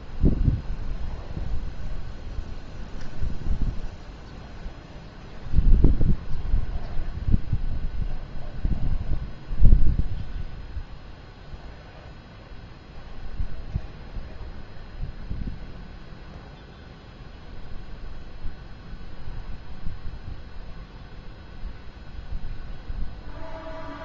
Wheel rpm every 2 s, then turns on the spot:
0, 0, 0, 0, 0, 0, 0, 0, 0, 0, 0, 0.
none